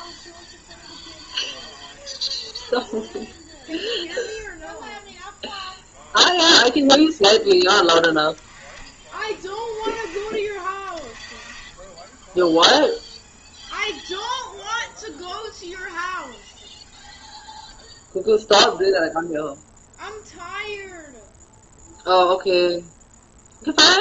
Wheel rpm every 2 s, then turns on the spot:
0, 0, 0, 0, 20, 30, 0, 0, 0, 0, 0, 0.
none